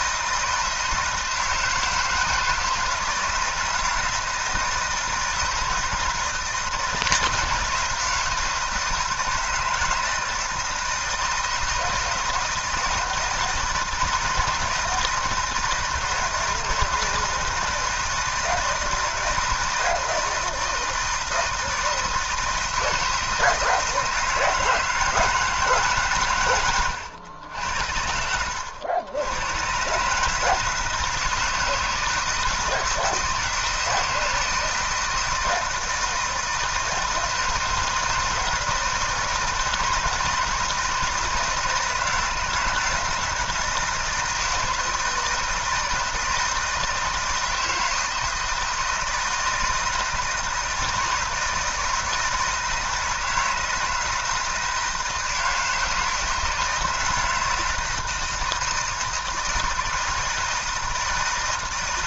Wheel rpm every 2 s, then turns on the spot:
160, 160, 160, 160, 160, 160, 160, 160, 160, 160, 160, 170, 160, 110, 80, 160, 160, 170, 160, 160, 160, 160, 160, 160, 160, 160, 160, 160, 160, 160, 160.
26-28